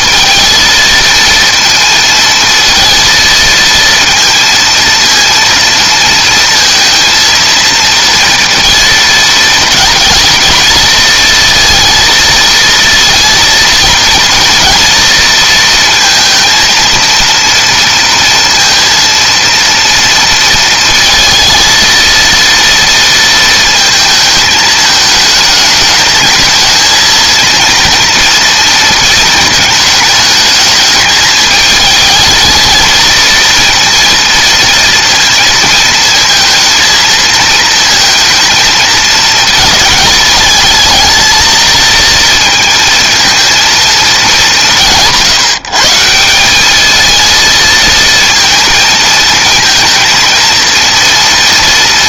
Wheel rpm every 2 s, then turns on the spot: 230, 230, 230, 230, 230, 220, 230, 230, 230, 230, 230, 230, 220, 220, 240, 220, 220, 230, 220, 230, 220, 230, 210, 170, 230, 230.
none